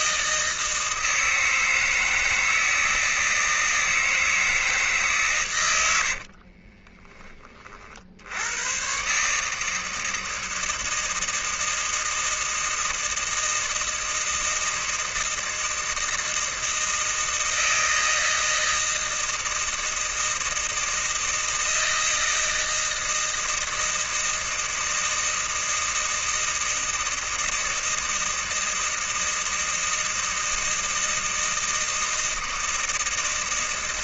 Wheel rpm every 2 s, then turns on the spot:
160, 160, 160, 30, 120, 160, 160, 160, 160, 160, 160, 160, 160, 160, 160, 160, 160.
6-8